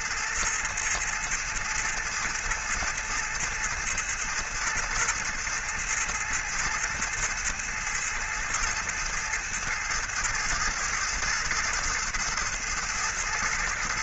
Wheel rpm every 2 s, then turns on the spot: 110, 110, 110, 110, 110, 110, 110.
none